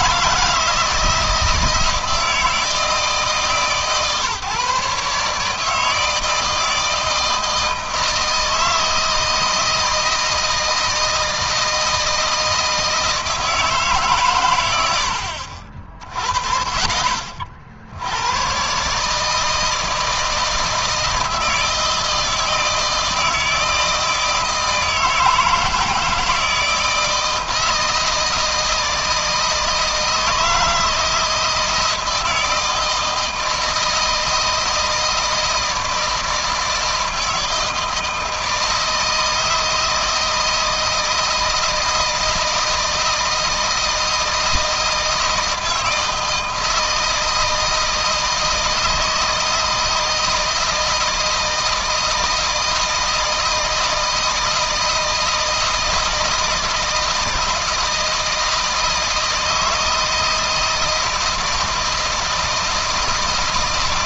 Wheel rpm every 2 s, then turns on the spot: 160, 160, 140, 160, 160, 160, 160, 80, 50, 140, 160, 160, 160, 160, 160, 160, 160, 160, 160, 160, 160, 170, 160, 160, 160, 160, 160, 160, 160, 160, 160, 160.
none